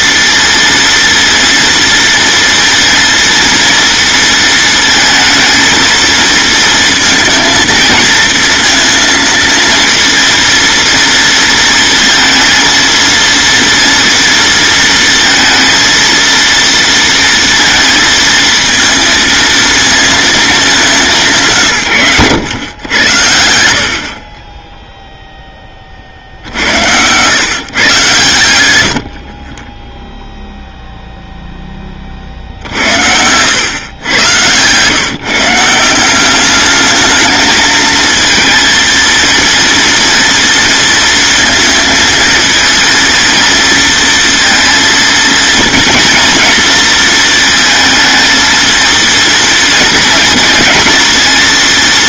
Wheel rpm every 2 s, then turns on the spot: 230, 230, 230, 220, 230, 230, 230, 230, 230, 230, 200, 100, 0, 90, 70, 0, 70, 140, 220, 230, 230, 230, 230, 220, 230, 230.
32-34